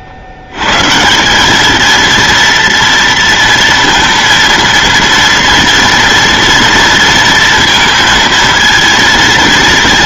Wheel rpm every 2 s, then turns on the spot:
110, 230, 230, 230, 230.
none